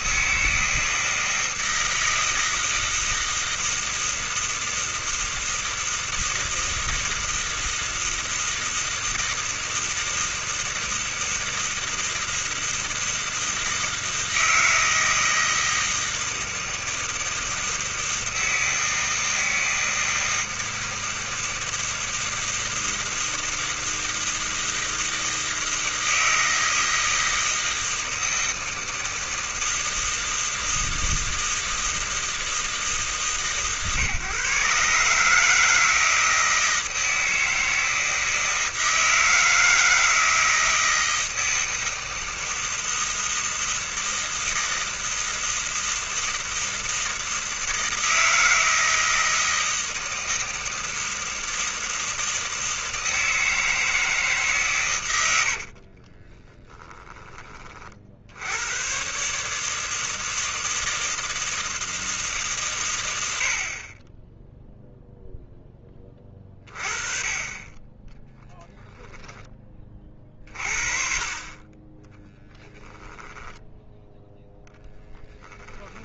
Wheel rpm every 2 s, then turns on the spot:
160, 160, 160, 160, 160, 160, 160, 160, 160, 160, 160, 160, 160, 160, 160, 160, 150, 140, 160, 160, 160, 160, 160, 160, 160, 160, 160, 120, 20, 130, 160, 110, 0, 30, 10, 30, 10, 10.
56-58 72-74